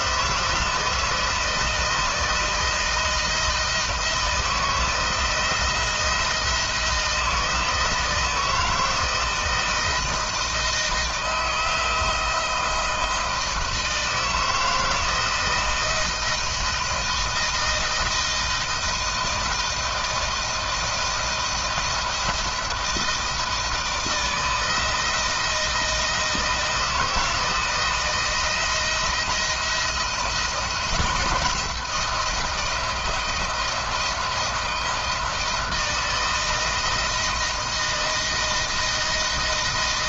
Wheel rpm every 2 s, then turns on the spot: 160, 160, 160, 170, 160, 160, 160, 160, 170, 170, 170, 170, 160, 160, 170, 170, 170, 160, 160, 160.
none